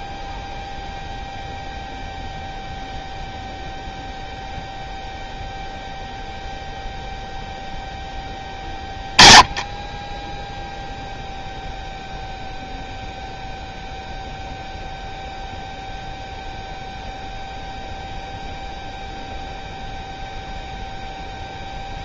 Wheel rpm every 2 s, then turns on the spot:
0, 0, 0, 0, 20, 0, 0, 0, 0, 0, 0.
none